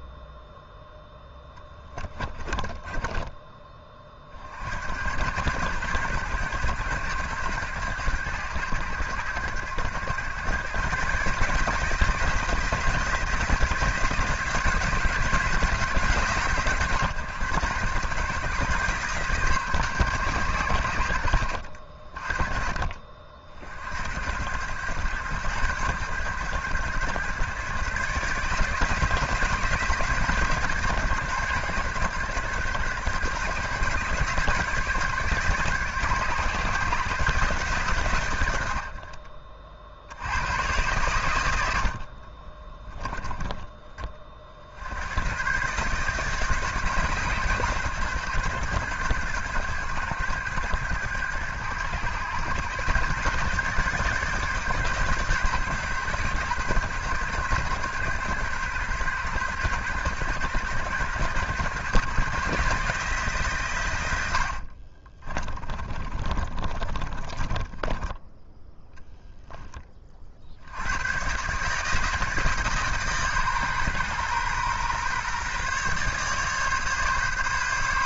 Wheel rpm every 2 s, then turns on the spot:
0, 10, 70, 110, 100, 130, 170, 170, 140, 140, 100, 40, 100, 110, 160, 140, 120, 150, 140, 90, 110, 20, 70, 150, 110, 110, 120, 140, 110, 120, 120, 150, 50, 30, 10, 90, 150, 130, 140.
2-4 42-44 64-68